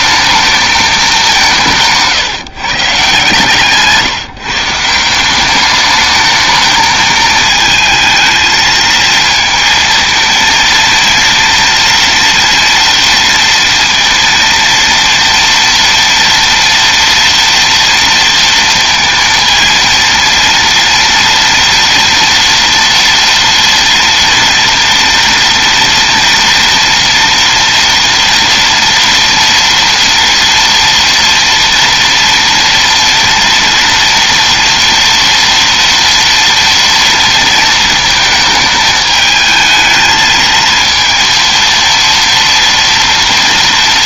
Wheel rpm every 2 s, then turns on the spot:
220, 150, 160, 220, 220, 230, 230, 230, 230, 230, 230, 230, 230, 230, 230, 230, 240, 230, 230, 220, 220, 230.
none